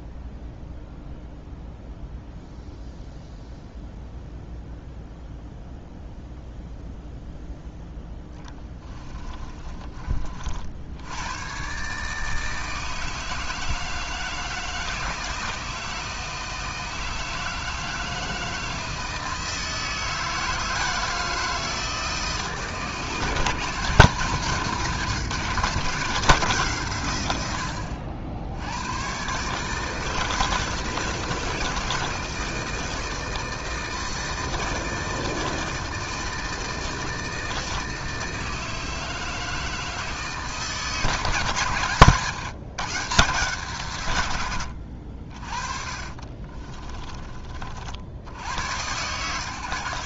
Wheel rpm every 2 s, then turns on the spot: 0, 0, 0, 0, 20, 70, 160, 160, 160, 160, 160, 160, 170, 150, 100, 170, 160, 160, 160, 160, 160, 140, 70, 20, 110.
8-10 46-48